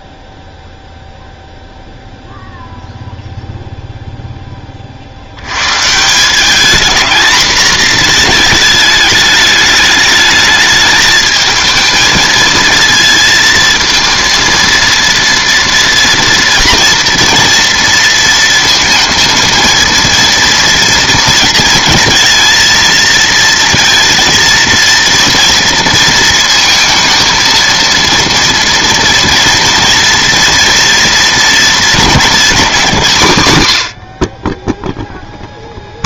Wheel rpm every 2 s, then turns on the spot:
0, 0, 10, 210, 220, 210, 220, 230, 230, 230, 230, 230, 230, 230, 230, 230, 210, 40.
none